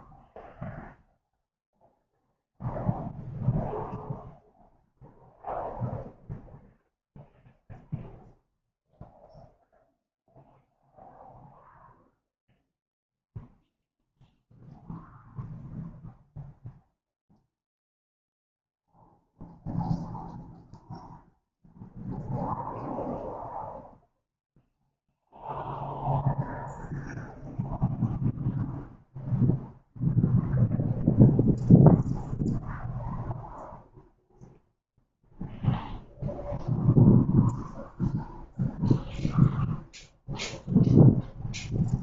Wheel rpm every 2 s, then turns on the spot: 0, 0, 0, 0, 0, 0, 0, 0, 0, 0, 0, 0, 0, 0, 0, 0, 0, 0, 0, 0, 0.
none